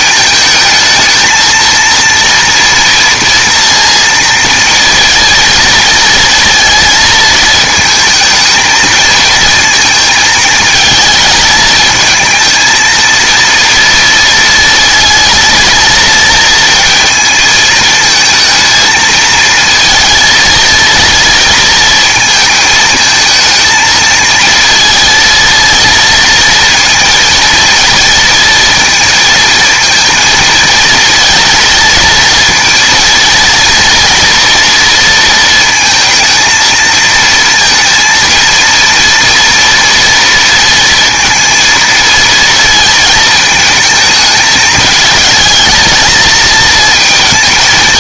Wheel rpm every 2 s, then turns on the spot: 220, 230, 230, 230, 220, 220, 220, 230, 230, 220, 230, 220, 230, 230, 230, 230, 230, 230, 230, 230, 230, 230, 220, 220.
none